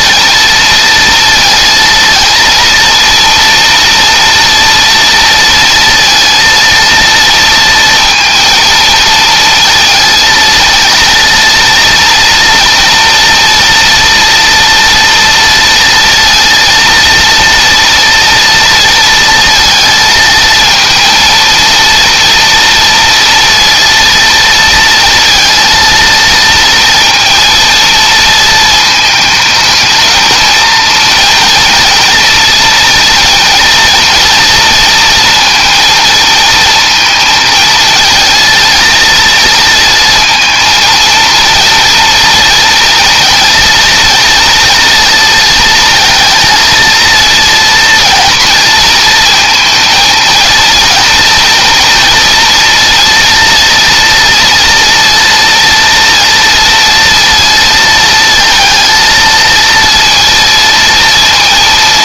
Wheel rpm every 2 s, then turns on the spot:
230, 230, 230, 230, 230, 230, 240, 230, 230, 230, 220, 230, 230, 230, 220, 230, 230, 230, 230, 230, 230, 230, 230, 230, 220, 230, 230, 230, 230, 230, 230.
none